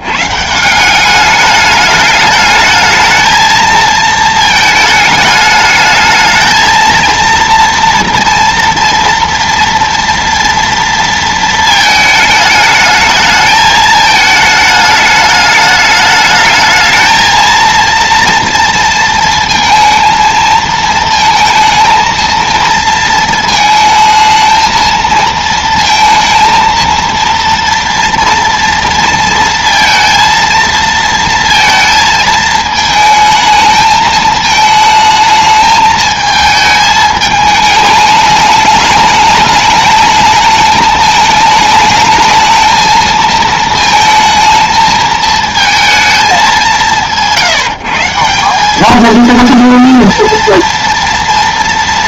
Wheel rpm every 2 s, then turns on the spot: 160, 220, 220, 220, 230, 230, 220, 210, 220, 230, 230, 230, 220, 230, 230, 230, 220, 220, 220, 210, 220, 220, 220, 190, 200, 230.
none